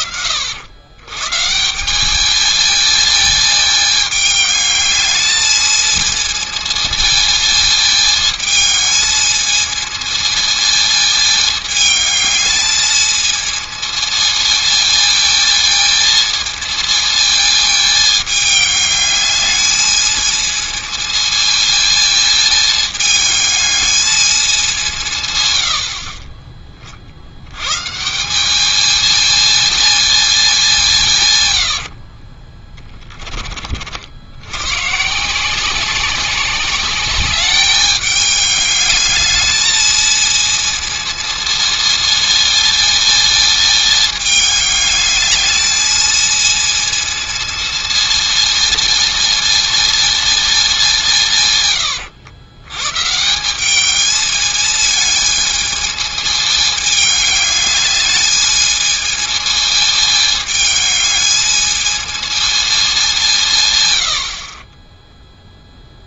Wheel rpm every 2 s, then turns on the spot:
110, 220, 210, 220, 220, 220, 220, 220, 220, 210, 220, 220, 180, 50, 220, 180, 20, 130, 200, 210, 220, 230, 210, 230, 220, 190, 120, 220, 210, 220, 210, 210, 20.
32-34